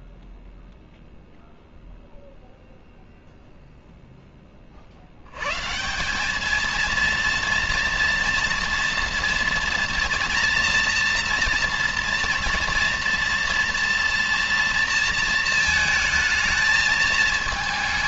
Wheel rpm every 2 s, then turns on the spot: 0, 0, 20, 210, 230, 230, 230, 230, 220.
none